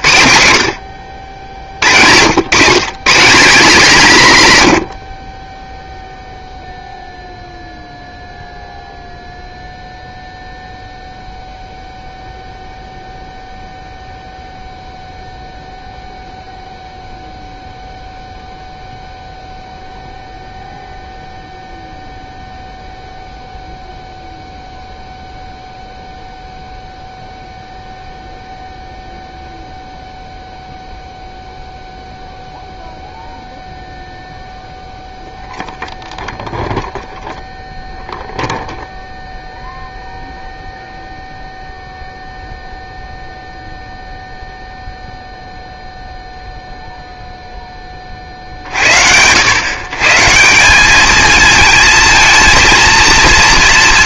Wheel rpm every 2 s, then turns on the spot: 60, 150, 90, 0, 0, 0, 0, 0, 0, 0, 0, 0, 0, 0, 0, 0, 0, 0, 0, 0, 0, 0, 0, 0, 60, 200, 230.
none